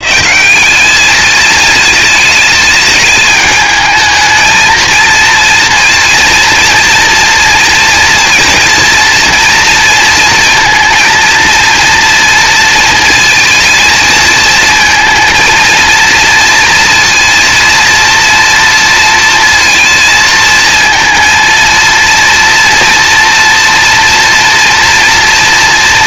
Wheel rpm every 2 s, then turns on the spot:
200, 210, 230, 240, 230, 230, 230, 220, 230, 230, 230, 230, 240.
none